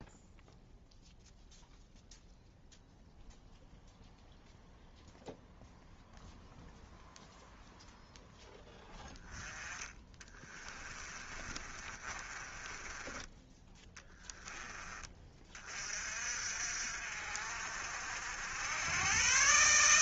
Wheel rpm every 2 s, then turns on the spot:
0, 0, 0, 0, 0, 20, 20, 10, 50, 80.
10-14